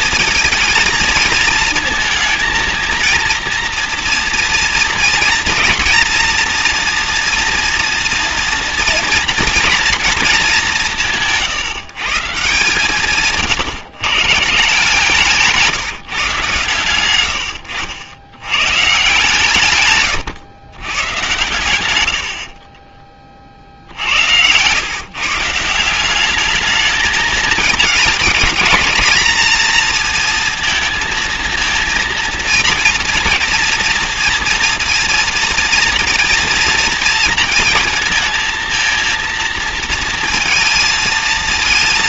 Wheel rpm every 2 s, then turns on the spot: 230, 230, 230, 240, 230, 170, 140, 160, 110, 140, 110, 20, 130, 210, 230, 230, 230, 230, 230, 230, 230.
none